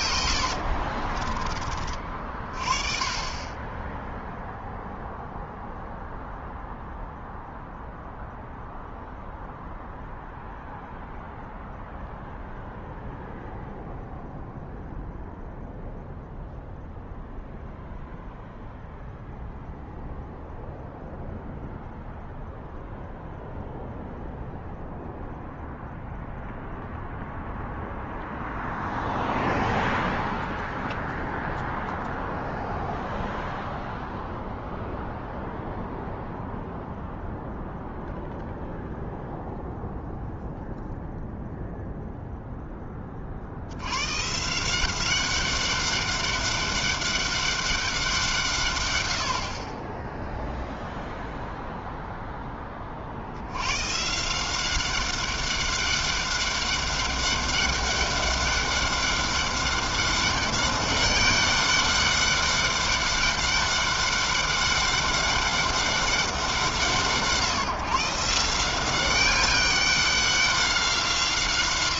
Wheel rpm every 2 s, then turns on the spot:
40, 30, 0, 0, 0, 0, 0, 0, 0, 0, 0, 0, 0, 0, 0, 0, 0, 0, 0, 0, 0, 50, 190, 200, 70, 0, 70, 200, 200, 200, 200, 200, 200, 160, 200, 170.
0-2